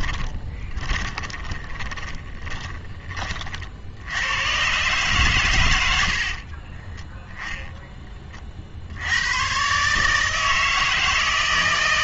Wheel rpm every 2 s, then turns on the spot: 20, 20, 120, 40, 50, 160.
0-2 6-8